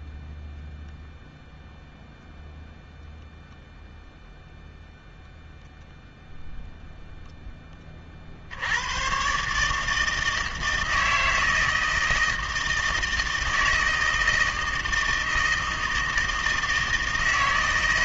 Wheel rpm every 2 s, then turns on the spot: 0, 0, 0, 0, 100, 160, 160, 160, 160.
none